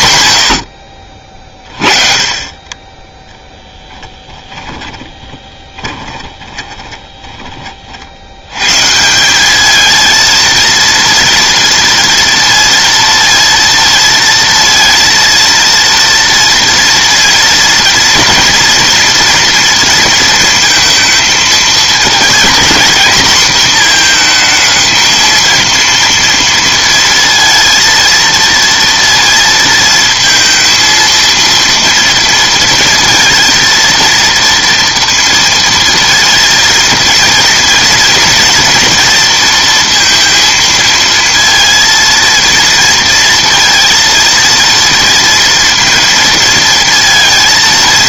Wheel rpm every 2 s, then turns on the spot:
70, 20, 20, 20, 130, 230, 230, 230, 230, 230, 230, 240, 230, 230, 230, 230, 230, 230, 230, 230, 230, 230, 230, 230.
4-8